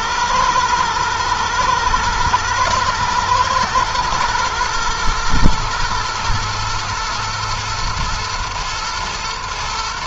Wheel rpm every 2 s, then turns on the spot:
110, 110, 120, 120, 110.
none